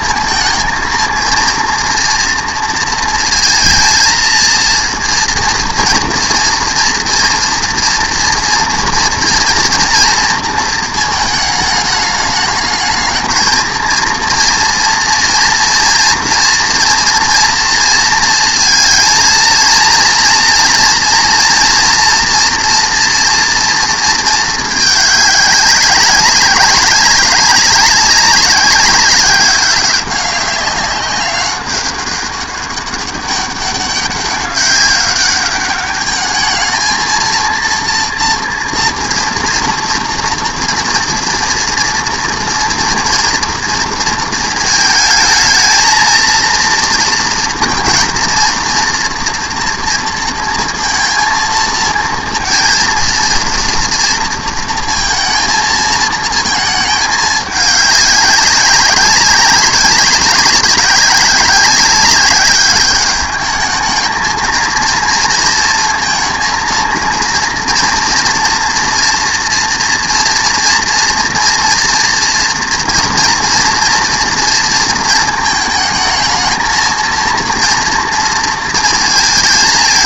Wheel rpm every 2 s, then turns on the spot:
230, 230, 230, 240, 240, 230, 210, 230, 230, 220, 230, 230, 220, 190, 200, 200, 200, 200, 220, 230, 230, 230, 220, 230, 230, 230, 230, 230, 220, 190, 200, 200, 230, 230, 230, 230, 230, 230, 220, 230.
none